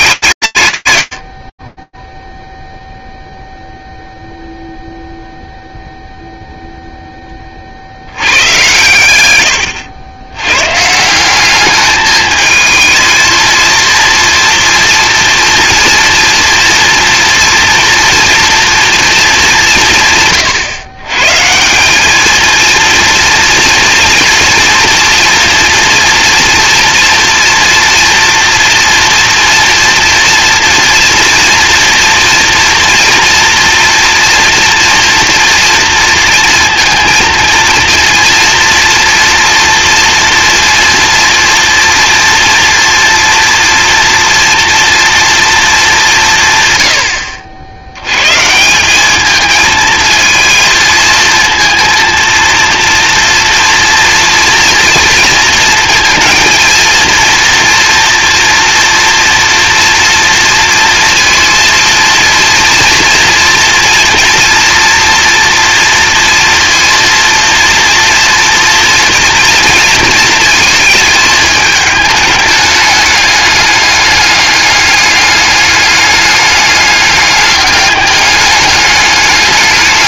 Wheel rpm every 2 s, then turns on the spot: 110, 0, 0, 10, 110, 170, 220, 230, 230, 230, 130, 230, 230, 230, 230, 240, 230, 230, 220, 230, 230, 230, 230, 90, 210, 220, 230, 230, 230, 230, 230, 230, 230, 230, 230, 220, 210, 200, 210, 210.
none